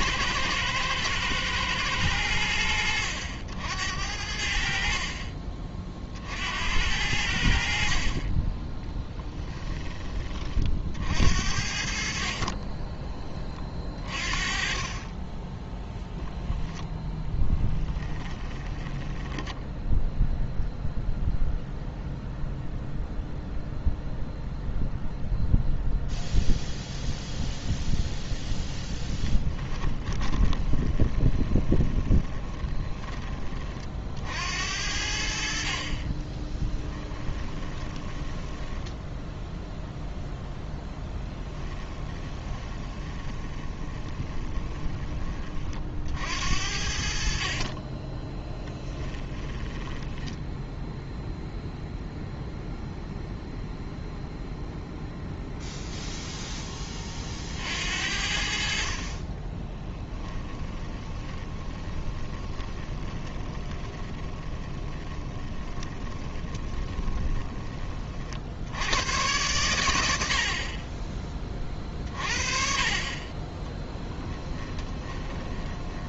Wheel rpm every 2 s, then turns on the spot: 110, 80, 60, 80, 20, 50, 20, 30, 10, 20, 0, 0, 0, 0, 0, 20, 20, 70, 10, 10, 10, 20, 20, 60, 10, 0, 0, 0, 20, 50, 10, 30, 20, 30, 90, 30, 30, 10.
8-10 18-20 30-32 36-40 42-44 48-50 60-68 74-76